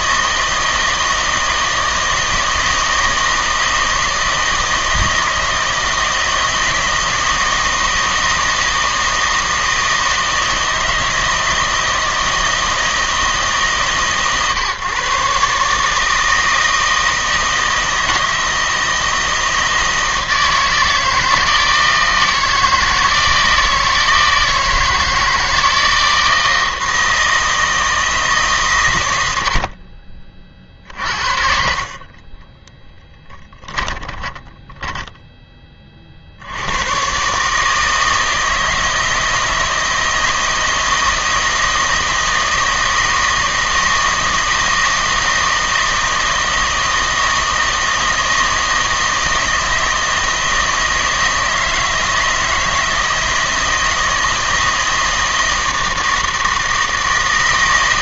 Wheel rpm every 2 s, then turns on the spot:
160, 160, 160, 160, 160, 160, 160, 140, 160, 160, 160, 160, 160, 160, 140, 40, 10, 10, 80, 160, 160, 160, 160, 160, 160, 160, 160, 160, 160.
32-36